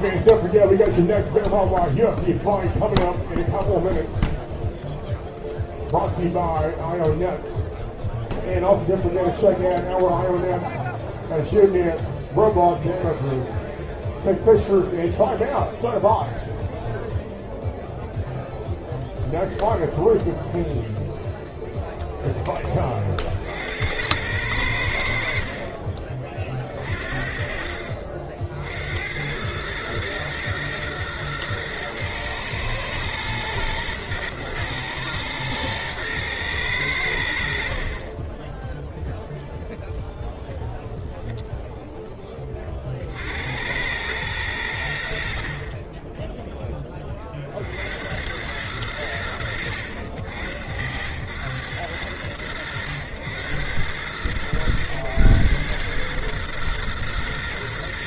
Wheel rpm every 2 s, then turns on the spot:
0, 0, 0, 0, 0, 0, 0, 0, 0, 0, 0, 70, 40, 50, 110, 120, 120, 120, 50, 0, 0, 80, 40, 40, 80, 90, 100, 110, 120.
44-46